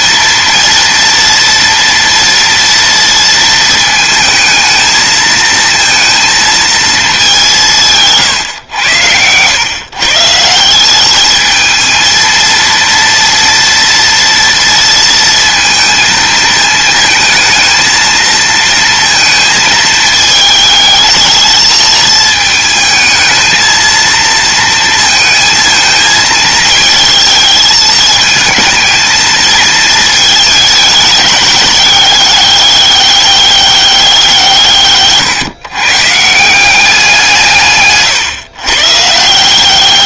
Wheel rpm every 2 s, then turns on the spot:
230, 230, 220, 220, 100, 190, 230, 230, 220, 230, 220, 220, 220, 220, 220, 210, 200, 150, 180, 140.
none